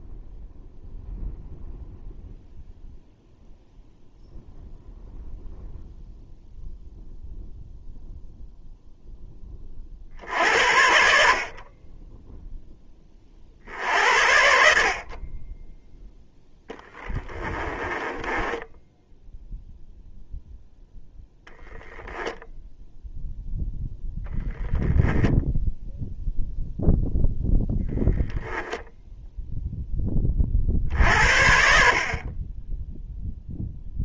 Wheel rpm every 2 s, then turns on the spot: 0, 0, 0, 0, 0, 60, 10, 60, 10, 10, 0, 0, 0, 0, 0, 50, 10.
16-20